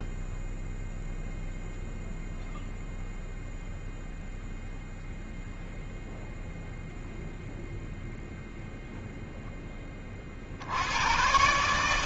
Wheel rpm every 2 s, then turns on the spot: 0, 0, 0, 0, 0, 90.
none